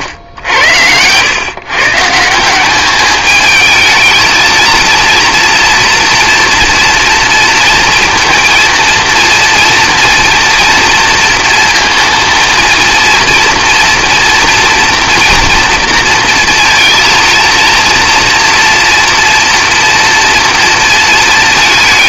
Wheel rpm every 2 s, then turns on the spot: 90, 200, 230, 240, 230, 230, 230, 240, 230, 230, 230.
none